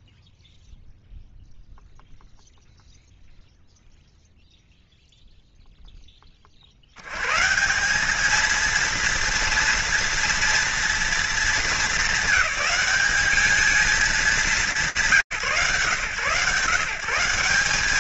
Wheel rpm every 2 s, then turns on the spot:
0, 0, 0, 30, 220, 240, 210, 190, 150.
none